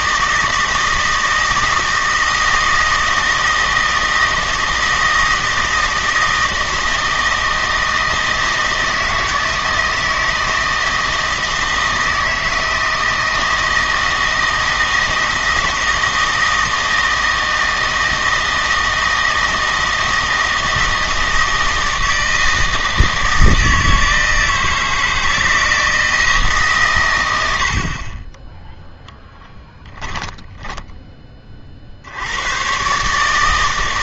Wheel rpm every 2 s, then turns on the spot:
160, 160, 160, 160, 160, 160, 160, 160, 160, 160, 160, 160, 160, 140, 0, 10, 130.
none